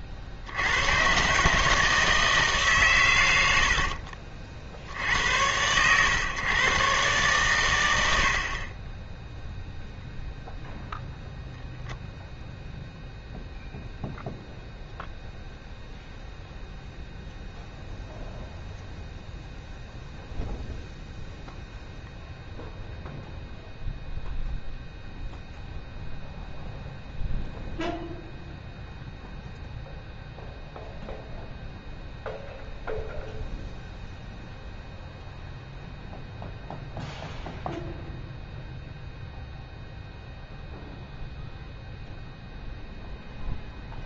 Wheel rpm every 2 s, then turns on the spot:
90, 140, 60, 120, 30, 0, 0, 0, 0, 0, 0, 0, 0, 0, 0, 0, 0, 0, 0, 0, 0, 0.
none